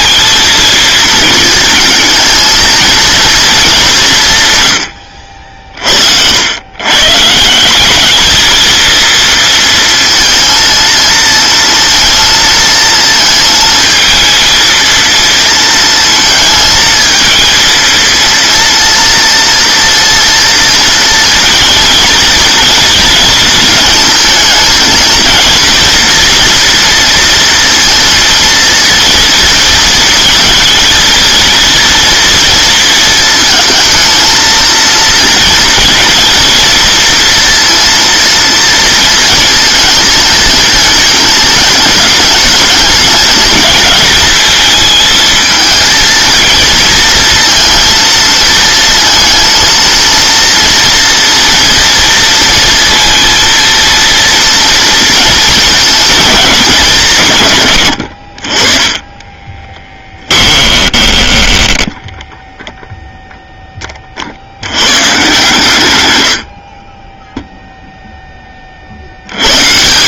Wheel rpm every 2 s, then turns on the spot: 230, 230, 110, 110, 220, 230, 230, 230, 230, 230, 230, 230, 230, 230, 230, 230, 230, 230, 230, 230, 220, 210, 220, 230, 230, 230, 230, 230, 200, 30, 20, 0, 90, 60, 40.
60-62 66-68